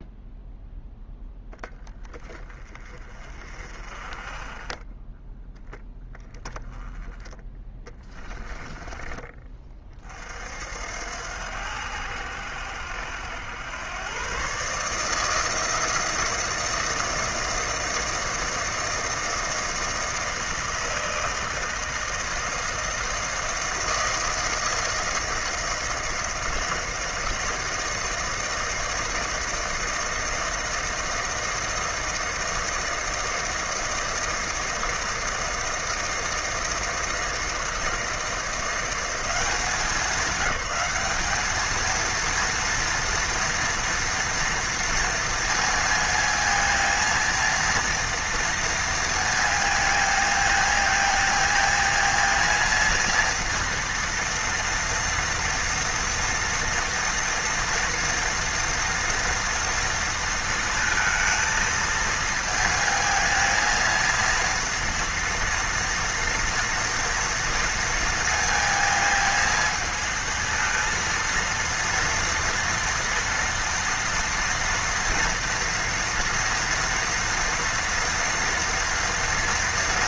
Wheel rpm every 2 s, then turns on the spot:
10, 30, 20, 10, 20, 70, 80, 150, 160, 160, 160, 170, 160, 160, 160, 160, 160, 160, 160, 170, 200, 230, 230, 230, 230, 220, 230, 230, 240, 230, 230, 230, 230, 230, 220, 230, 230, 230, 230, 230.
8-10